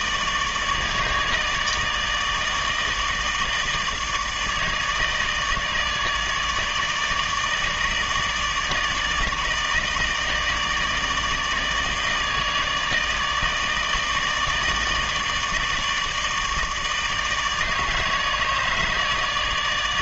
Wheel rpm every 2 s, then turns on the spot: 160, 150, 150, 150, 150, 160, 160, 160, 150, 150.
none